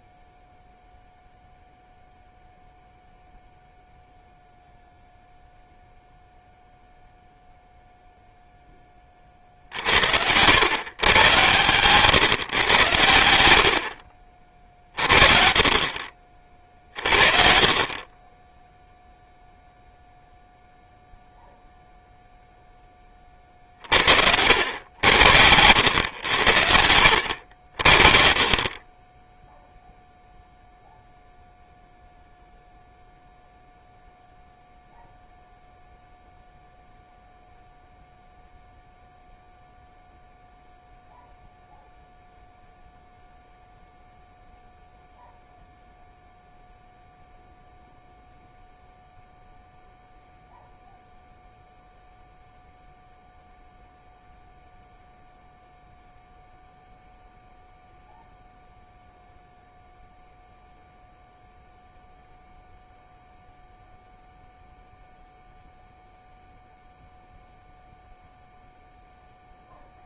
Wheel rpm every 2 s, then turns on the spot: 0, 0, 0, 0, 10, 130, 120, 50, 50, 10, 0, 0, 80, 80, 30, 0, 0, 0, 0, 0, 0, 0, 0, 0, 0, 0, 0, 0, 0, 0, 0, 0, 0, 0, 0.
26-28